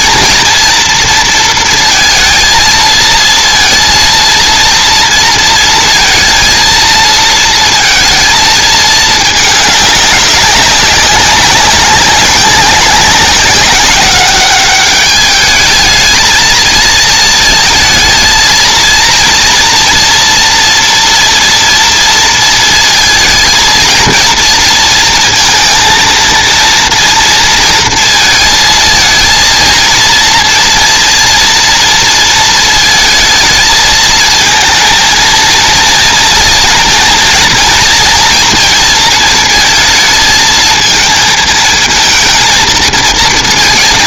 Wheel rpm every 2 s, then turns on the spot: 230, 230, 230, 230, 210, 200, 190, 210, 230, 230, 230, 230, 230, 230, 230, 230, 220, 230, 230, 220, 230, 230.
none